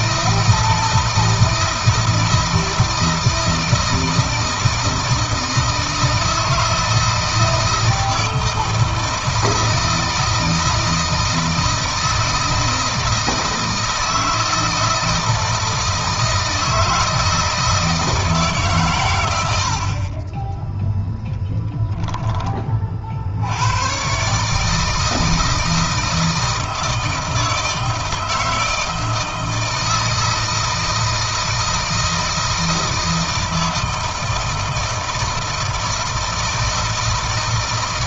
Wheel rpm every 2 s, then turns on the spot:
160, 160, 160, 160, 160, 160, 160, 160, 160, 150, 10, 30, 150, 160, 160, 160, 160, 160, 160.
none